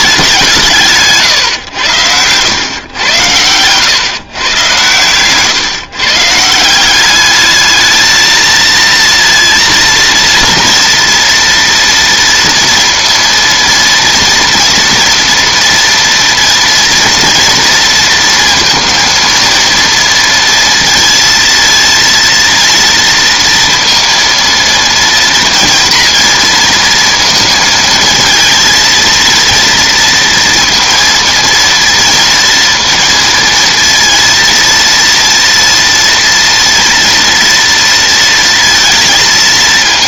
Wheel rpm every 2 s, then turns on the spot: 170, 110, 130, 180, 230, 230, 230, 230, 230, 230, 230, 230, 230, 230, 230, 230, 230, 230, 230, 230.
none